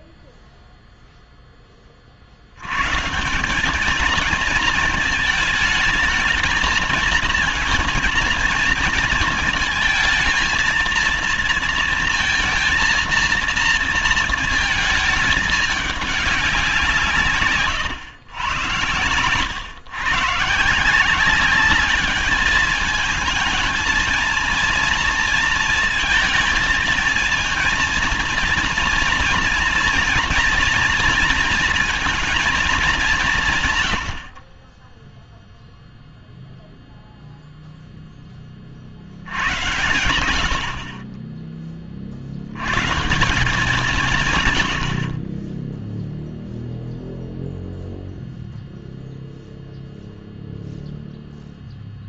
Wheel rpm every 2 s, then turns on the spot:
0, 120, 220, 220, 230, 230, 230, 220, 180, 110, 160, 210, 230, 230, 230, 240, 220, 30, 0, 50, 40, 130, 90, 0, 0, 0.
none